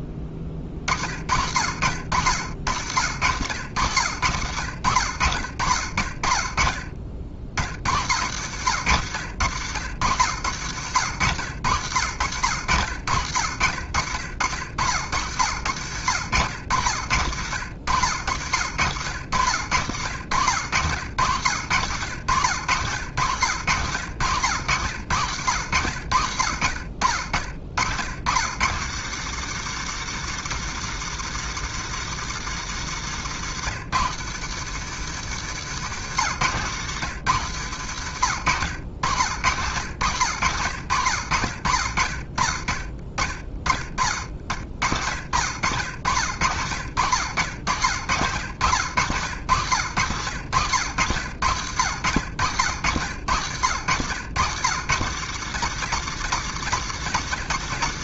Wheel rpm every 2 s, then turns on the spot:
30, 80, 70, 40, 100, 100, 80, 80, 90, 80, 80, 100, 90, 60, 140, 160, 150, 150, 140, 100, 70, 10, 50, 80, 100, 100, 90, 120, 130.
32-34